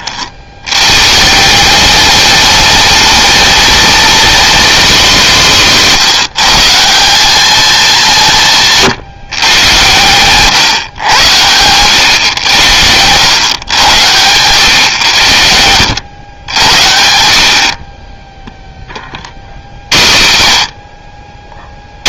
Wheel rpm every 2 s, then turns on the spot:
130, 220, 210, 180, 150, 130, 90, 100, 70, 30, 80.
none